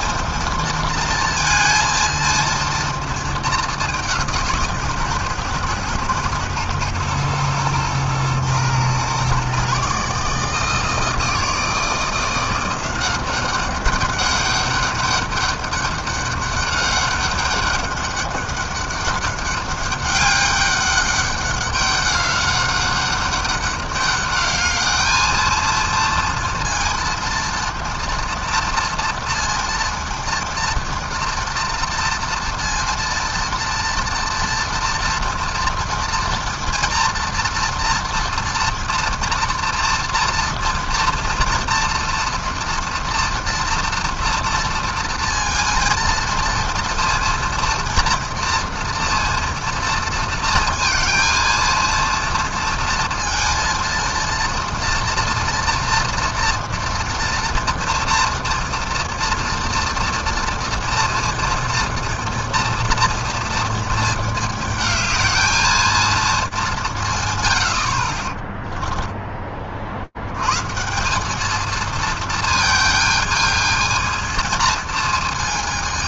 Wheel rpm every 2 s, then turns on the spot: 230, 230, 160, 120, 120, 150, 170, 200, 200, 200, 200, 200, 210, 230, 230, 230, 230, 230, 230, 230, 230, 240, 230, 230, 230, 230, 230, 230, 230, 230, 230, 230, 220, 200, 20, 130, 220, 230.
68-70